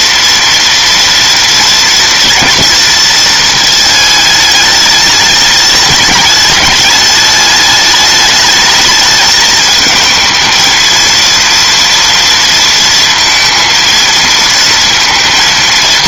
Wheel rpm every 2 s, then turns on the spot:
230, 230, 210, 210, 210, 220, 230, 230.
none